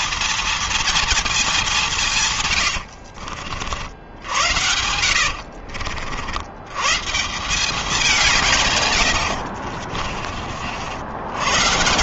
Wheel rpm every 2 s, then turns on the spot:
230, 120, 80, 90, 170, 40.
2-6